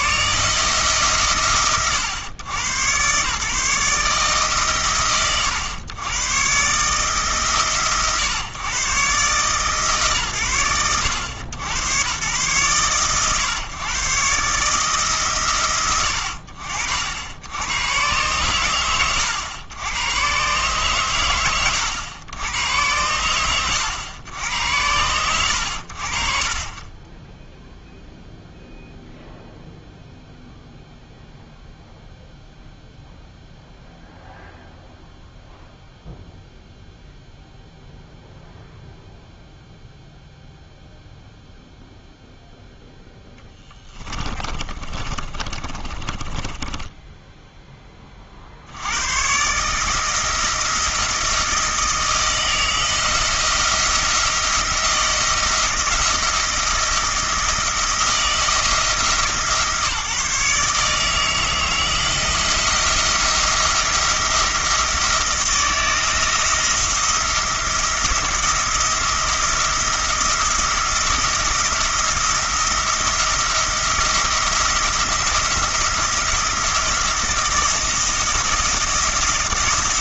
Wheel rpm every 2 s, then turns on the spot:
130, 110, 120, 140, 140, 90, 120, 150, 60, 90, 120, 90, 80, 30, 0, 0, 0, 0, 0, 0, 0, 0, 30, 10, 90, 170, 170, 170, 170, 160, 160, 170, 160, 170, 170, 170, 170, 170, 170, 170.
44-48